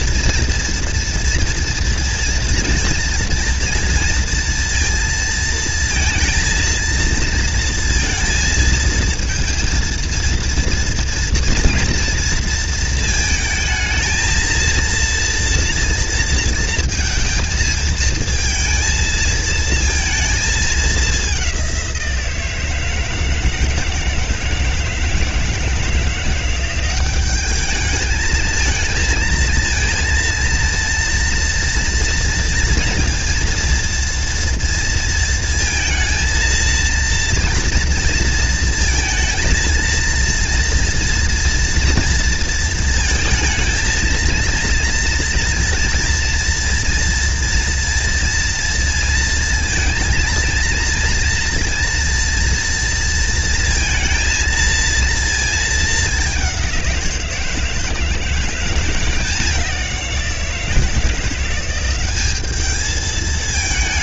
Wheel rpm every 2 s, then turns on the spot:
230, 230, 230, 230, 230, 230, 220, 230, 230, 230, 210, 160, 160, 190, 220, 230, 230, 230, 230, 230, 240, 230, 230, 230, 230, 230, 230, 230, 180, 180, 170, 220.
none